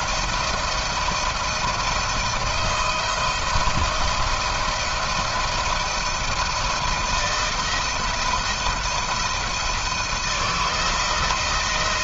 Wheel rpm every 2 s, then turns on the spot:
160, 170, 160, 160, 170, 160.
none